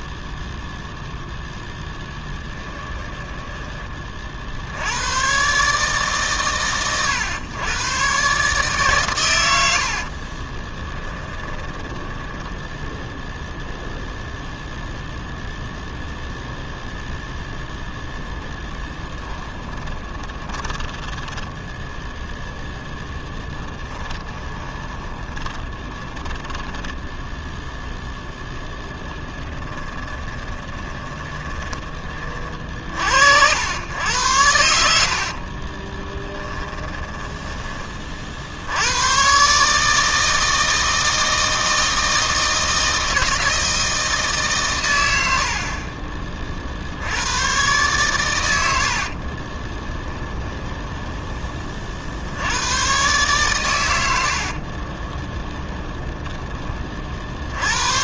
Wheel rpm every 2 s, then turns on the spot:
0, 10, 90, 120, 140, 20, 0, 0, 0, 20, 20, 0, 20, 10, 10, 20, 50, 80, 10, 80, 160, 160, 120, 60, 60, 10, 110, 40, 20.
2-4 10-12 18-22 24-32 36-38 48-52 54-56